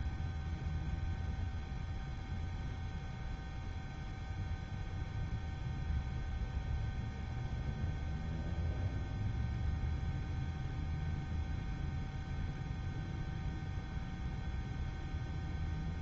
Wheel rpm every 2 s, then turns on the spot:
0, 0, 0, 0, 0, 0, 0, 0.
none